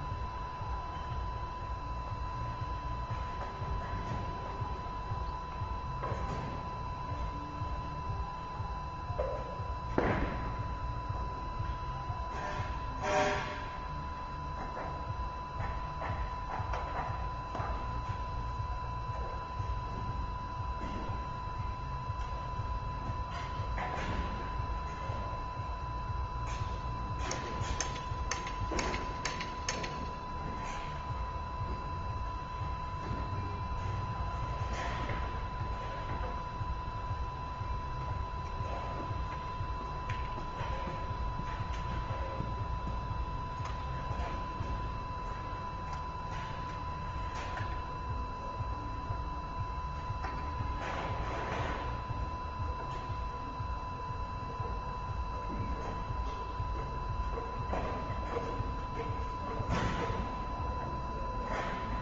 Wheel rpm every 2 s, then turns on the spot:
0, 0, 0, 0, 0, 0, 0, 0, 0, 0, 0, 0, 0, 0, 0, 0, 0, 0, 0, 0, 0, 0, 0, 0, 0, 0, 0, 0, 0, 0, 0.
none